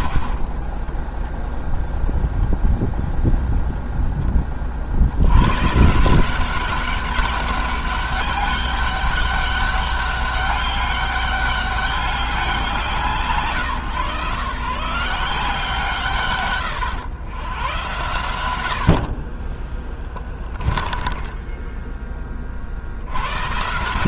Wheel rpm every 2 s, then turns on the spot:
40, 0, 30, 180, 200, 200, 190, 160, 120, 60, 10, 50.
18-22